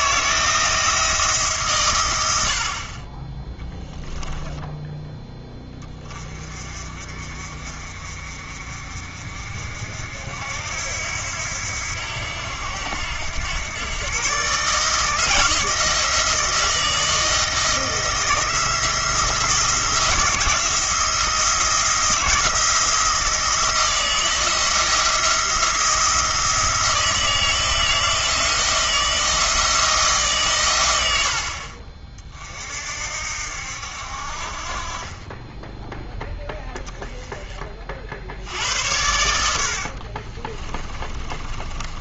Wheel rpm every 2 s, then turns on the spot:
160, 50, 10, 40, 50, 80, 80, 150, 160, 170, 170, 160, 170, 160, 160, 120, 50, 40, 20, 80, 20.
4-6 40-42